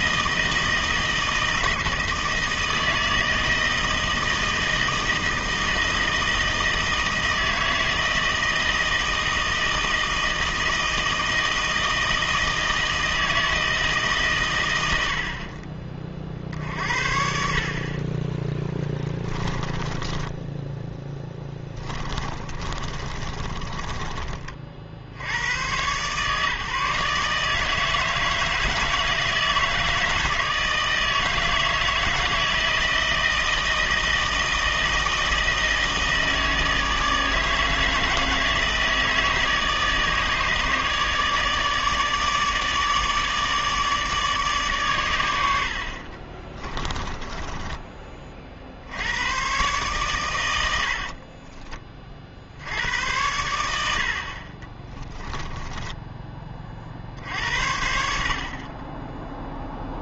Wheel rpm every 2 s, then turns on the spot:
160, 160, 160, 160, 160, 160, 160, 100, 60, 10, 10, 40, 40, 150, 160, 160, 160, 160, 160, 160, 150, 150, 130, 20, 70, 80, 80, 20, 40, 30.
18-24 46-48 50-52 54-56